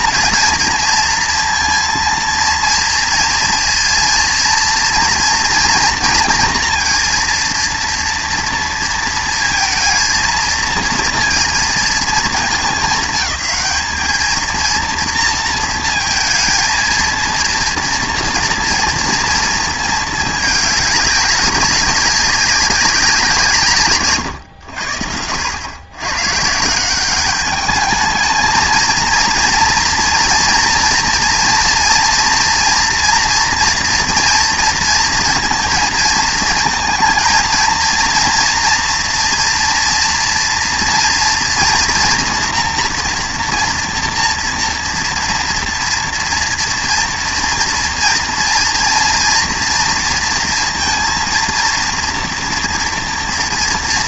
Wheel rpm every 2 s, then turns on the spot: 230, 230, 240, 230, 230, 230, 210, 230, 230, 230, 210, 190, 80, 180, 230, 230, 240, 230, 220, 230, 230, 230, 230, 230, 230, 230, 230.
none